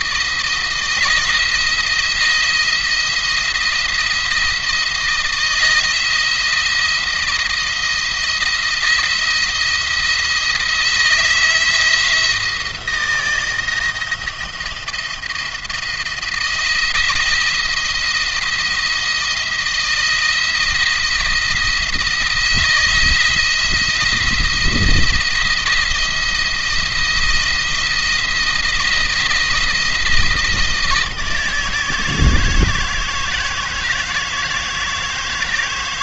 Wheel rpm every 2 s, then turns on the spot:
160, 170, 170, 160, 170, 170, 160, 170, 170, 170, 170, 170, 170, 170, 160, 160, 160, 160.
none